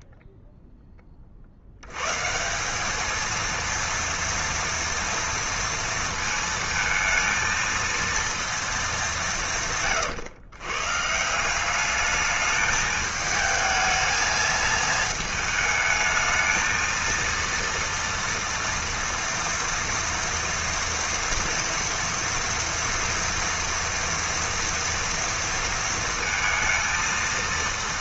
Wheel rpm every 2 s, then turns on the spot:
0, 180, 230, 230, 220, 120, 210, 220, 230, 230, 230, 230, 230, 230.
none